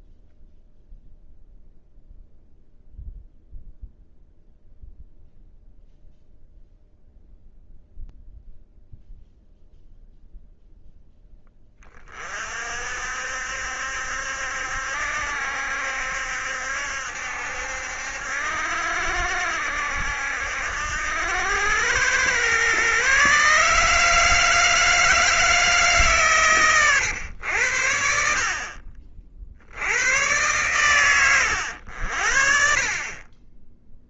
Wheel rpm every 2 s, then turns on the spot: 0, 0, 0, 0, 0, 0, 50, 70, 70, 70, 80, 130, 160, 110, 50, 120, 30.
none